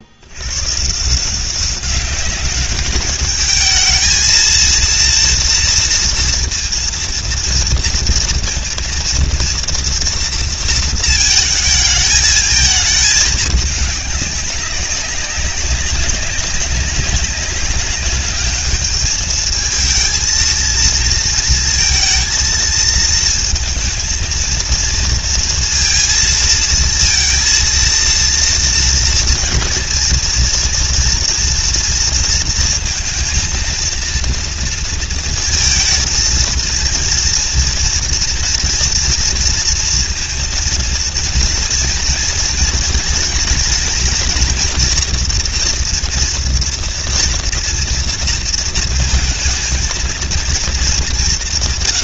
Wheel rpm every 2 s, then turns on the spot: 140, 200, 230, 230, 230, 230, 220, 200, 200, 210, 230, 230, 230, 230, 230, 230, 220, 230, 230, 230, 230, 230, 240, 230, 230, 190.
none